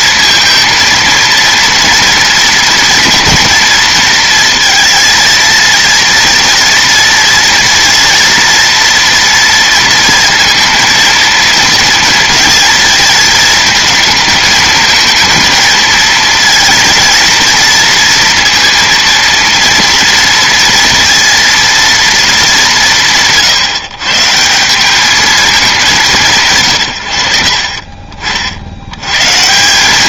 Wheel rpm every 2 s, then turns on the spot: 230, 230, 230, 230, 230, 230, 220, 230, 230, 230, 230, 150, 200, 90, 110.
none